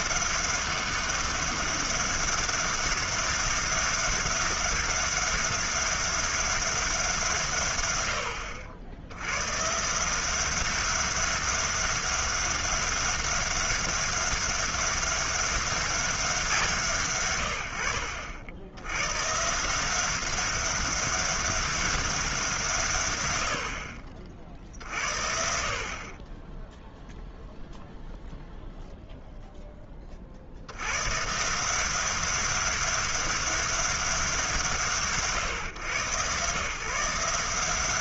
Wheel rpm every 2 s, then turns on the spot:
190, 200, 200, 170, 110, 200, 200, 200, 120, 130, 200, 100, 60, 0, 0, 110, 200, 150, 160.
none